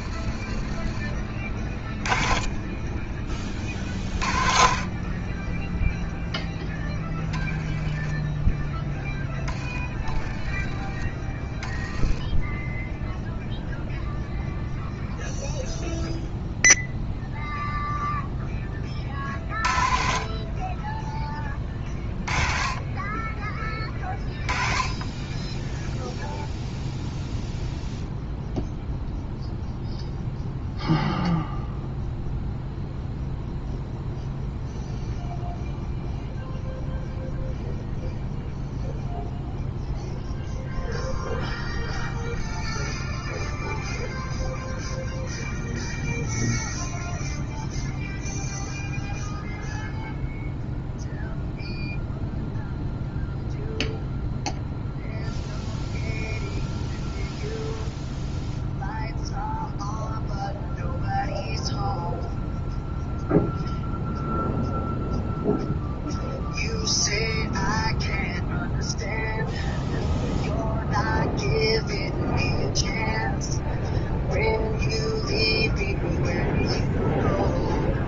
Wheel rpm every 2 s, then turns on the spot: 20, 10, 40, 10, 10, 20, 0, 0, 0, 20, 20, 30, 30, 0, 0, 0, 0, 0, 0, 0, 0, 0, 0, 0, 0, 0, 0, 0, 0, 0, 0, 0, 0, 0, 0, 0, 0, 0, 0.
0-2